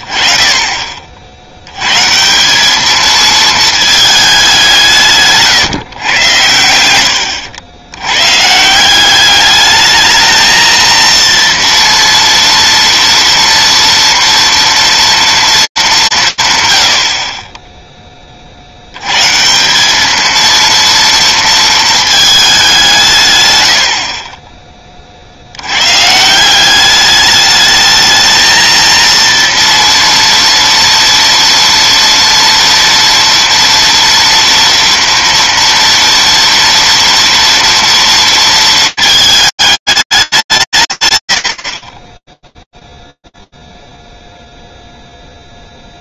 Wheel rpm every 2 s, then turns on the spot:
20, 190, 190, 100, 150, 230, 230, 230, 140, 70, 230, 180, 20, 190, 230, 230, 230, 230, 230, 220, 180, 10, 0.
none